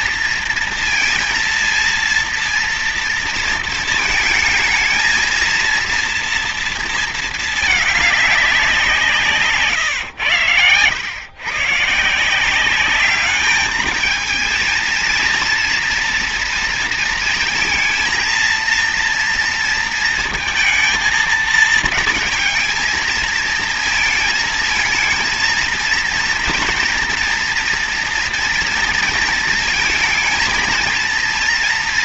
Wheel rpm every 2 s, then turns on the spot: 230, 230, 230, 230, 190, 110, 180, 220, 230, 230, 230, 220, 220, 230, 230, 230.
none